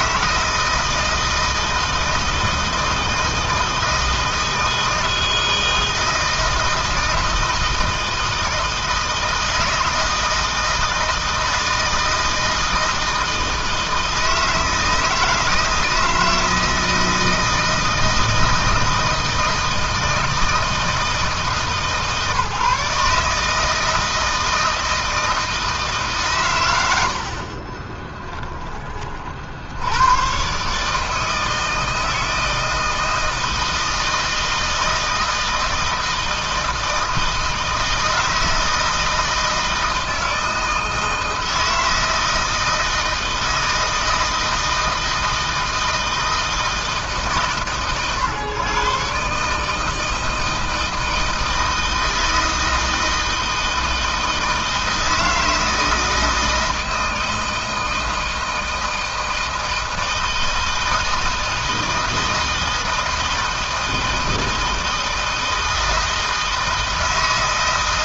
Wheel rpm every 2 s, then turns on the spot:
160, 160, 160, 160, 160, 160, 160, 160, 160, 160, 160, 140, 160, 100, 30, 140, 160, 160, 160, 160, 160, 160, 160, 160, 130, 160, 160, 160, 160, 160, 160, 160, 160, 160.
26-28